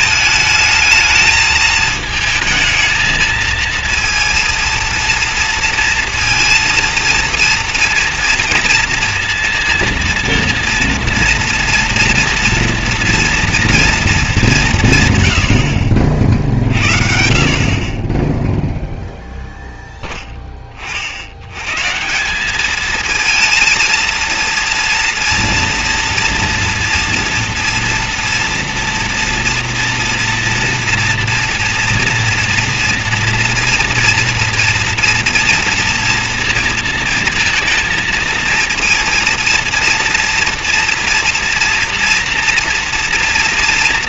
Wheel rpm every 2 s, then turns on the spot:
220, 220, 230, 230, 230, 230, 230, 210, 50, 0, 20, 200, 230, 230, 230, 230, 230, 230, 230, 230, 230, 230.
none